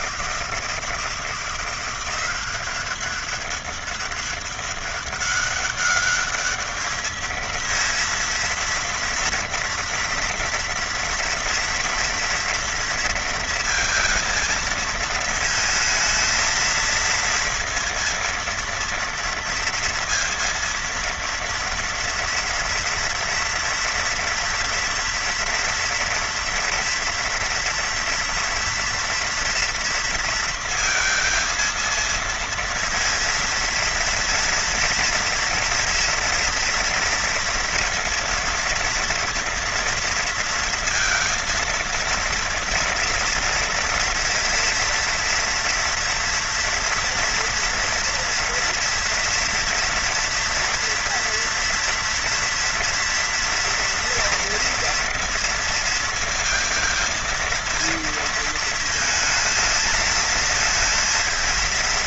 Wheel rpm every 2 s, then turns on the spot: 160, 190, 200, 210, 230, 240, 230, 230, 230, 230, 230, 230, 230, 230, 230, 230, 230, 230, 230, 230, 230, 230, 230, 240, 230, 240, 240, 230, 230, 230, 230.
none